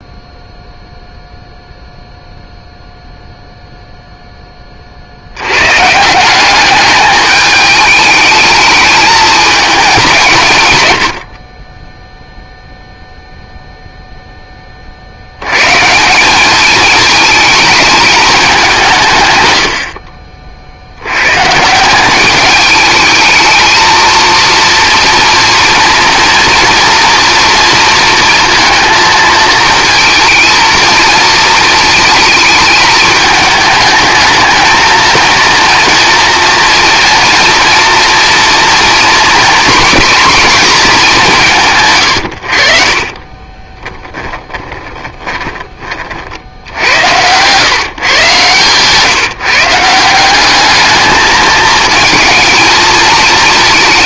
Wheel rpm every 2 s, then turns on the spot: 0, 0, 30, 200, 210, 110, 0, 30, 210, 180, 60, 210, 230, 230, 230, 220, 220, 220, 240, 230, 220, 60, 30, 70, 130, 200, 230.
44-46